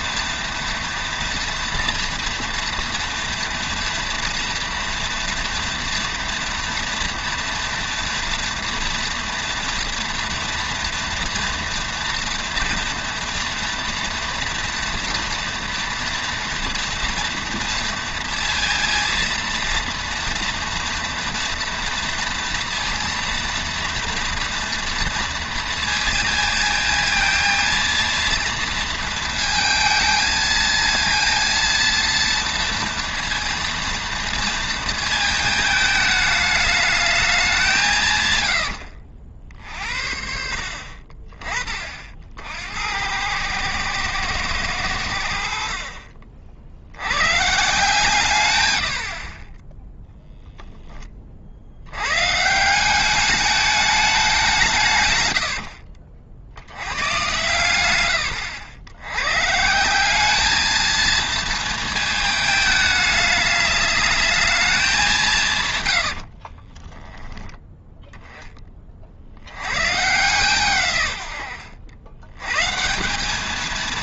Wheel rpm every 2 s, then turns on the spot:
230, 230, 240, 230, 230, 230, 240, 230, 230, 230, 230, 230, 230, 230, 230, 220, 230, 230, 210, 80, 60, 80, 120, 60, 110, 10, 170, 170, 90, 90, 220, 220, 210, 30, 20, 140, 140.
38-40 66-68